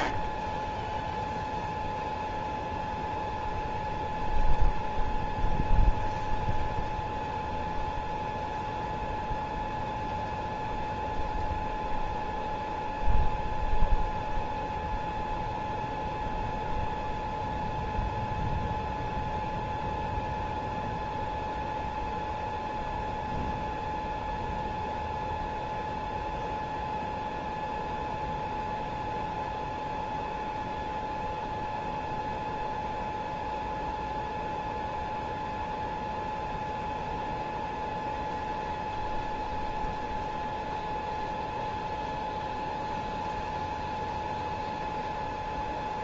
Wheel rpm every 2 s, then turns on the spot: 10, 0, 0, 0, 0, 0, 0, 0, 0, 0, 0, 0, 0, 0, 0, 0, 0, 0, 0, 0, 0, 0, 0.
none